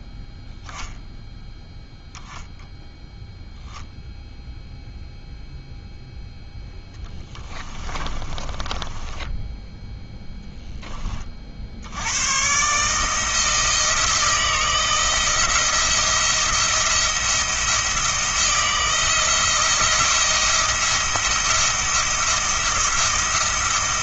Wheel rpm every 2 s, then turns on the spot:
10, 0, 0, 10, 10, 10, 140, 160, 170, 170, 170, 170.
6-10